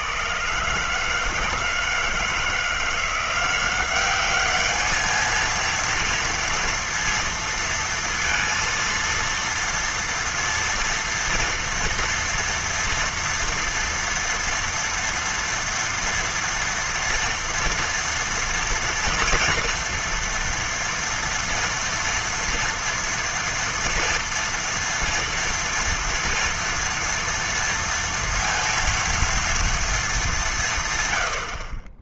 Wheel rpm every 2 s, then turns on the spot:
130, 160, 200, 230, 230, 230, 240, 230, 240, 230, 230, 230, 230, 230, 230, 180.
none